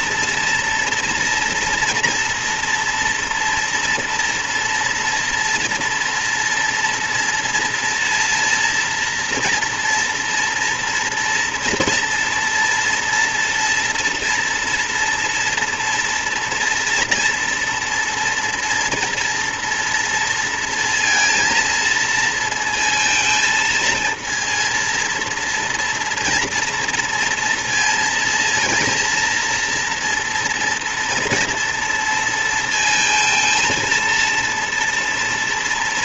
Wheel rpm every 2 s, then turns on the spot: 230, 240, 230, 230, 230, 230, 230, 230, 230, 230, 230, 230, 230, 230, 230, 230, 230, 230.
none